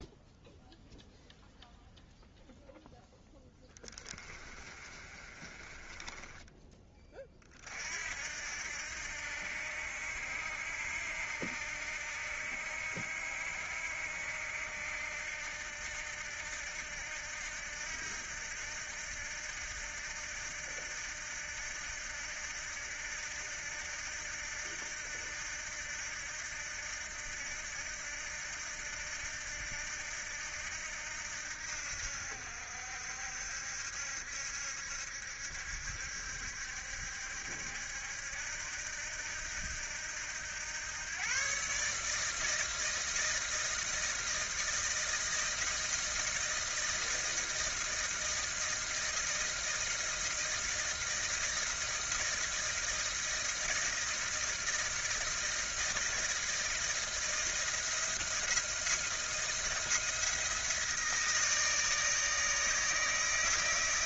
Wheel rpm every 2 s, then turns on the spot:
0, 0, 30, 30, 80, 80, 80, 80, 80, 80, 80, 80, 80, 80, 80, 80, 70, 70, 70, 80, 110, 160, 160, 160, 160, 160, 160, 160, 160, 160, 160, 140.
4-6